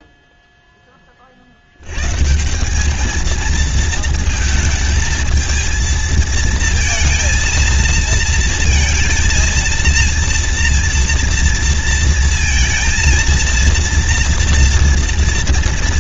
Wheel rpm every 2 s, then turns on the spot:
0, 160, 230, 230, 230, 230, 230, 230.
none